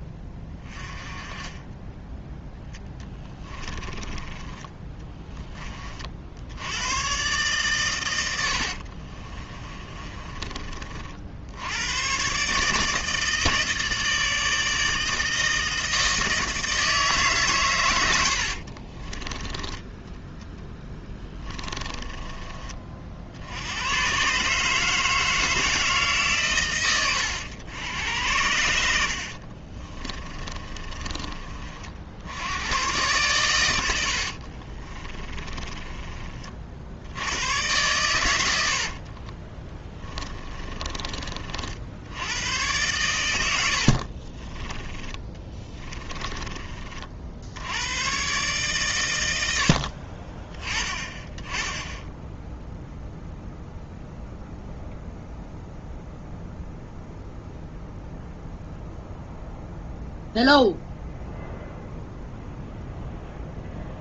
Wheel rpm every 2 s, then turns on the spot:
20, 10, 10, 90, 70, 30, 150, 160, 160, 40, 10, 30, 150, 130, 80, 30, 90, 40, 50, 80, 20, 110, 20, 30, 130, 20, 0, 0, 0, 0, 0, 0.
2-6 8-10 18-22 30-32 34-36 40-42 44-46